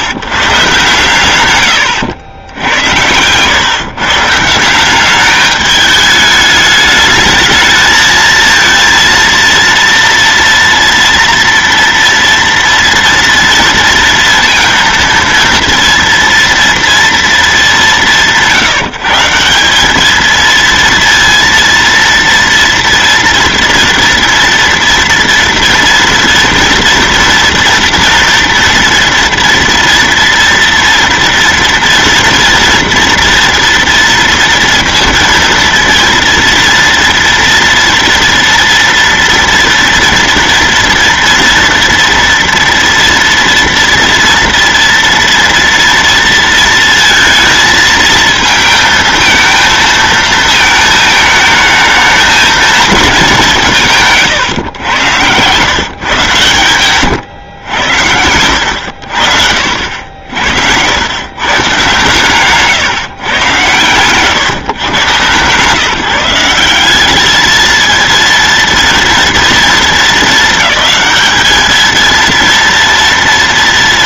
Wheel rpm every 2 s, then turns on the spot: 140, 90, 170, 210, 230, 240, 230, 230, 230, 170, 230, 230, 230, 230, 230, 230, 230, 230, 230, 240, 230, 230, 230, 230, 220, 220, 220, 110, 120, 90, 80, 140, 130, 200, 230, 220, 230.
none